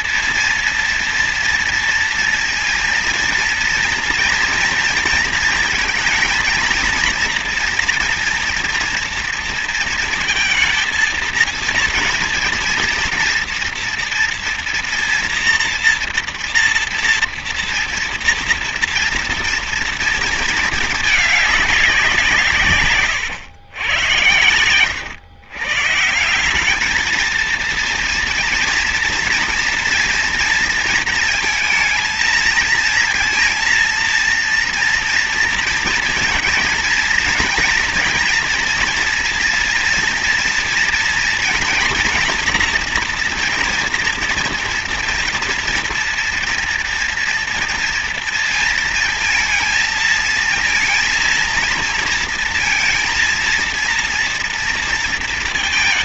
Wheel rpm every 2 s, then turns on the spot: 230, 230, 230, 230, 230, 230, 230, 230, 230, 230, 220, 150, 100, 200, 230, 230, 220, 230, 230, 230, 230, 230, 240, 240, 230, 220, 230, 230.
none